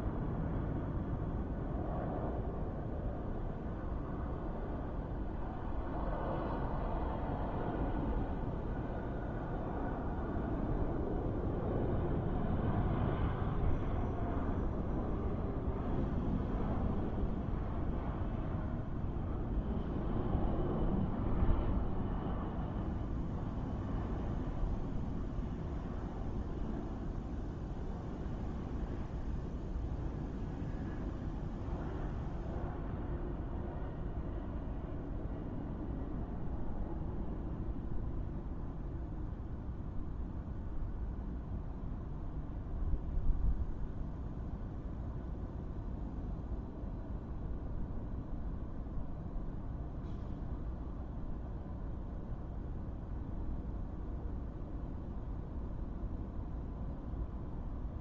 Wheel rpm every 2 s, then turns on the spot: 0, 0, 0, 0, 0, 0, 0, 0, 0, 0, 0, 0, 0, 0, 0, 0, 0, 0, 0, 0, 0, 0, 0, 0, 0, 0, 0, 0, 0.
none